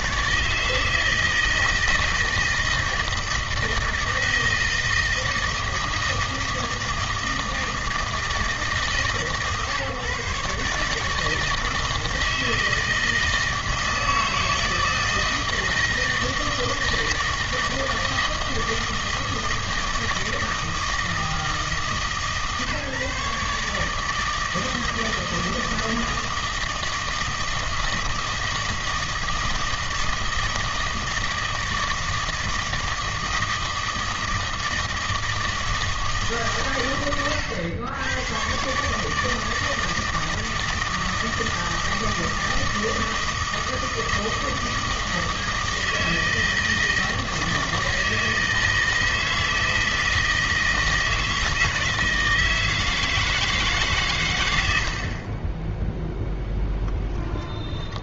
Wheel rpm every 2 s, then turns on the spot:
160, 160, 160, 160, 150, 150, 160, 160, 160, 160, 160, 150, 160, 160, 160, 160, 160, 160, 130, 130, 160, 160, 160, 160, 160, 160, 160, 90, 10.
56-58